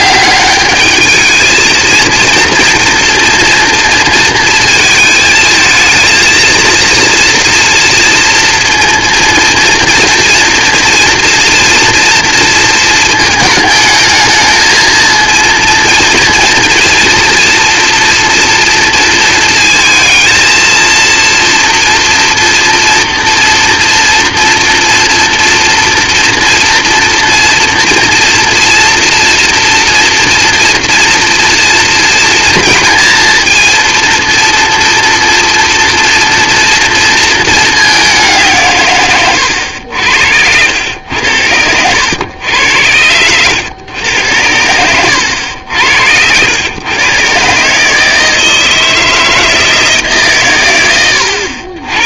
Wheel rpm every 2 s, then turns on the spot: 200, 230, 230, 230, 230, 230, 230, 220, 230, 230, 230, 230, 230, 230, 240, 230, 230, 230, 230, 170, 90, 100, 90, 90, 160, 140.
none